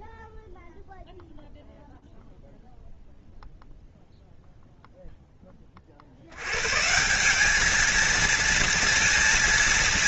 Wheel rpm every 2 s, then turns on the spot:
0, 0, 0, 160, 230.
none